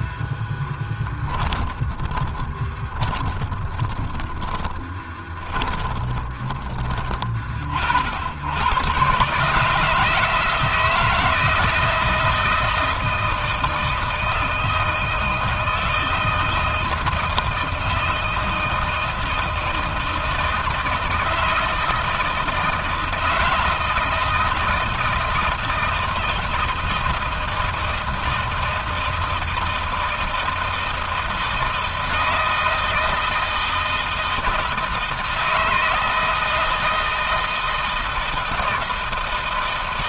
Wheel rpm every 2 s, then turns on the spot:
20, 30, 10, 20, 120, 160, 160, 160, 160, 170, 160, 160, 160, 160, 160, 160, 160, 160, 160, 160.
0-6